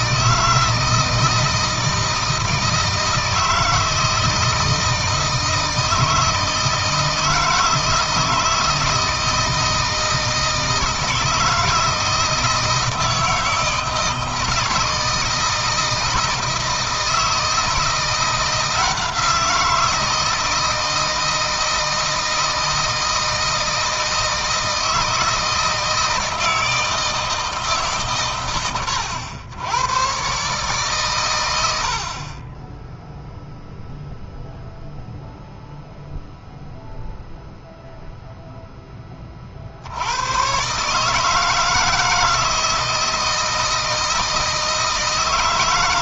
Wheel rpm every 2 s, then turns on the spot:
160, 160, 160, 160, 160, 160, 160, 160, 160, 170, 160, 160, 160, 160, 100, 130, 10, 0, 0, 10, 140, 160, 160.
none